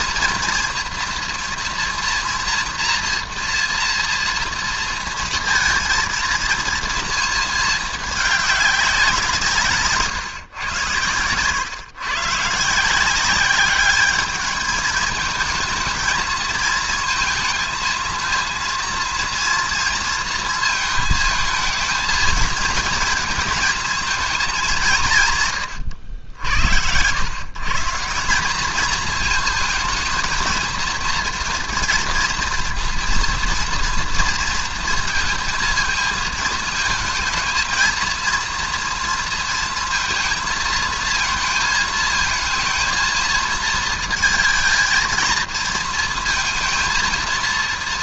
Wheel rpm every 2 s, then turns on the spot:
230, 230, 230, 230, 200, 120, 160, 210, 230, 230, 220, 230, 200, 90, 210, 230, 230, 230, 220, 230, 220, 220, 230, 230.
none